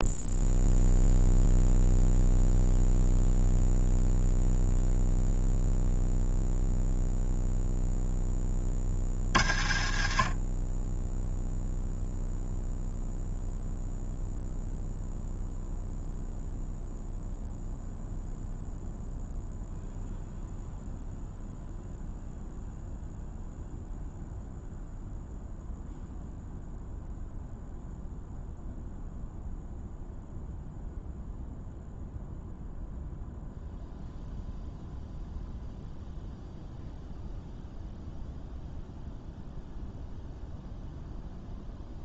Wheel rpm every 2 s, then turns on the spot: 0, 0, 0, 0, 40, 10, 0, 0, 0, 0, 0, 0, 0, 0, 0, 0, 0, 0, 0, 0, 0.
none